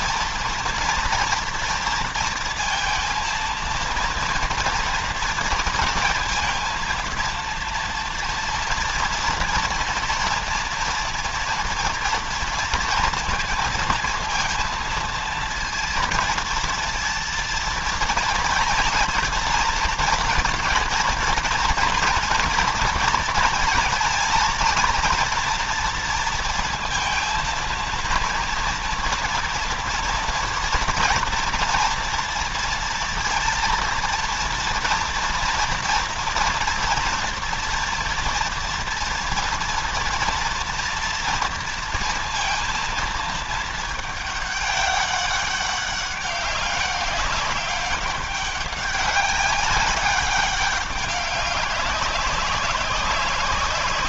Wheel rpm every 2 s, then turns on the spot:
230, 230, 230, 230, 230, 230, 230, 230, 230, 230, 230, 230, 230, 230, 230, 240, 230, 230, 230, 230, 240, 230, 200, 190, 200, 200, 190.
none